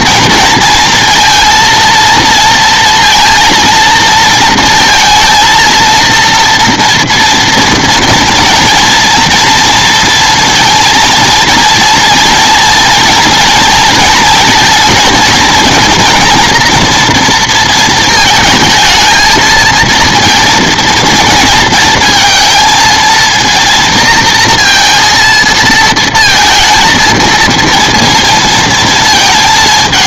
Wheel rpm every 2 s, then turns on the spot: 230, 230, 230, 230, 230, 230, 230, 230, 230, 220, 230, 230, 230, 230, 230.
none